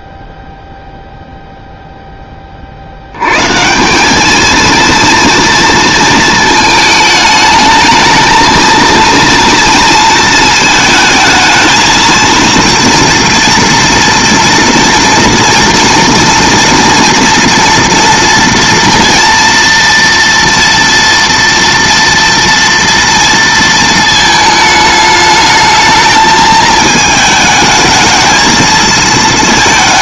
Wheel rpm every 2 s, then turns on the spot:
0, 70, 230, 220, 230, 230, 230, 230, 230, 230, 240, 230, 220, 220, 220.
none